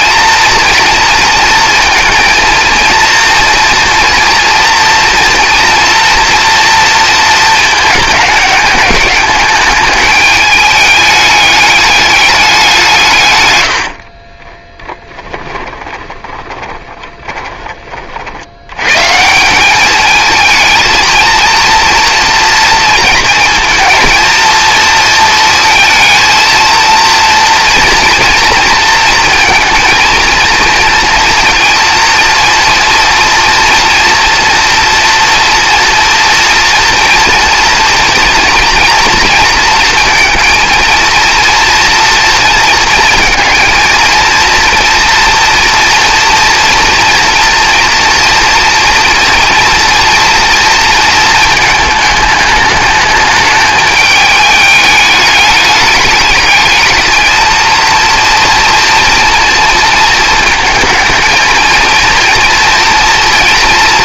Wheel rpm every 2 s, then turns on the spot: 240, 230, 240, 230, 210, 210, 190, 10, 20, 80, 220, 230, 230, 230, 230, 230, 230, 240, 230, 230, 230, 230, 230, 230, 240, 230, 210, 210, 220, 230, 220, 230.
14-18